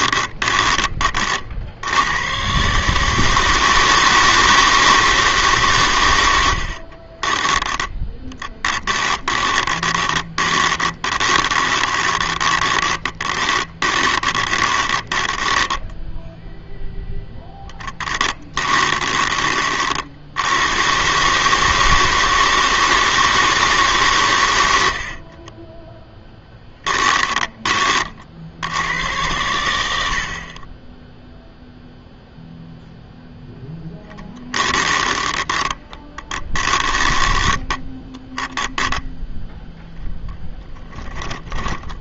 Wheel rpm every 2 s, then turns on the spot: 30, 150, 160, 50, 10, 20, 10, 20, 0, 20, 120, 160, 70, 10, 100, 20, 0, 20, 10, 10, 10.
6-16 18-20 24-28 34-38 40-42